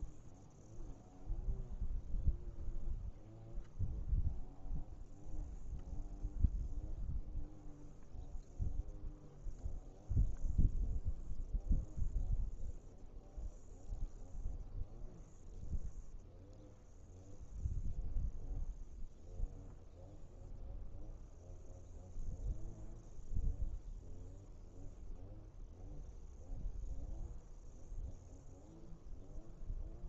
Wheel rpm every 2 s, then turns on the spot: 0, 0, 0, 0, 0, 0, 0, 0, 0, 0, 0, 0, 0, 0, 0.
none